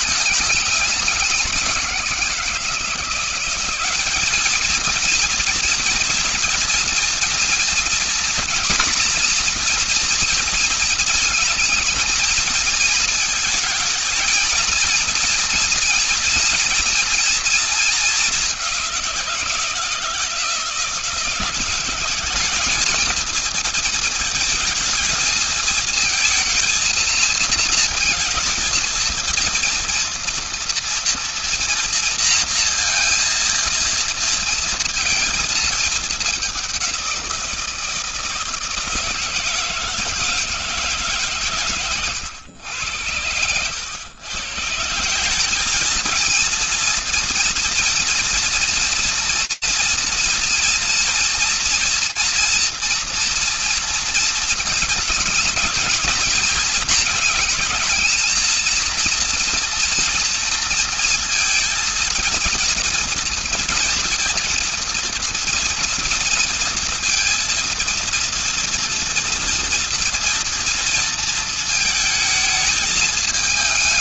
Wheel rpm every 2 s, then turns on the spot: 190, 190, 230, 230, 230, 220, 230, 240, 230, 170, 180, 220, 220, 230, 230, 230, 230, 220, 170, 160, 140, 100, 200, 230, 230, 240, 230, 220, 220, 240, 230, 230, 230, 230, 230, 230, 220.
none